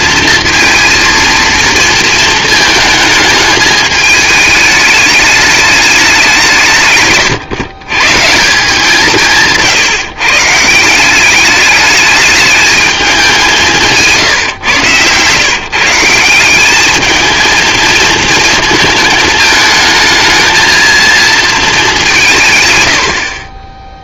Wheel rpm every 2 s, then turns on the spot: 230, 220, 210, 160, 170, 160, 210, 120, 200, 230, 230, 130.
none